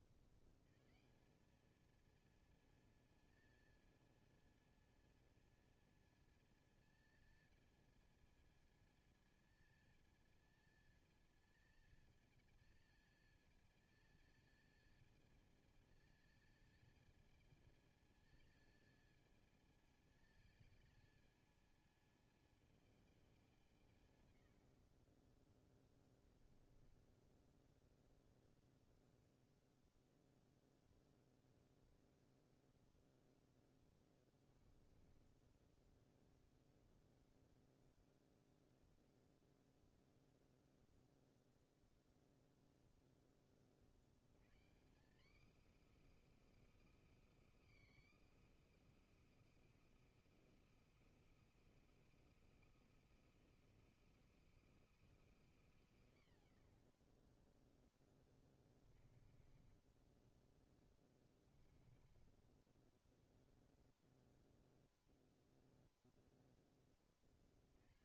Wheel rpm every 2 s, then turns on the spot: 120, 230, 230, 230, 230, 230, 230, 220, 220, 220, 220, 220, 70, 20, 0, 0, 0, 20, 0, 0, 0, 0, 150, 330, 330, 340, 340, 340, 100, 30, 30, 30, 0, 10.
26-28 34-36 58-60 62-64